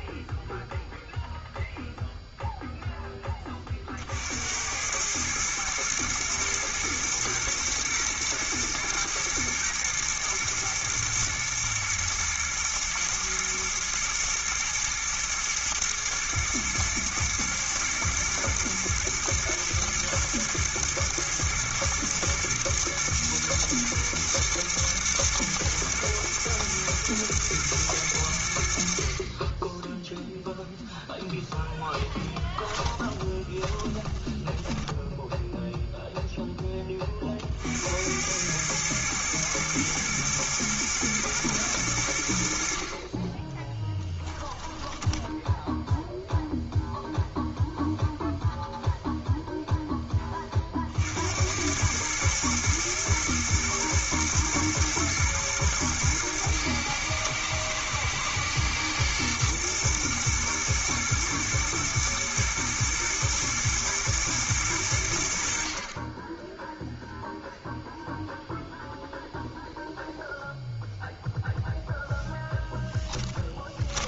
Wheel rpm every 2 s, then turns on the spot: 0, 0, 90, 110, 110, 110, 110, 110, 110, 120, 110, 110, 110, 110, 60, 0, 20, 10, 20, 110, 110, 50, 10, 0, 0, 50, 110, 110, 110, 120, 110, 110, 100, 0, 0, 0, 10.
32-36 44-46 72-74